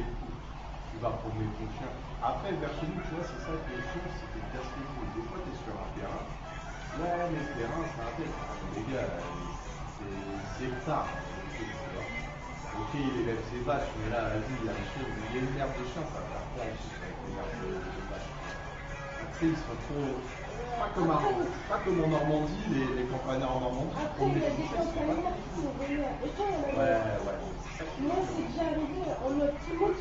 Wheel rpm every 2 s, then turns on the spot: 0, 0, 0, 0, 0, 0, 0, 0, 0, 0, 0, 0, 0, 0, 0.
none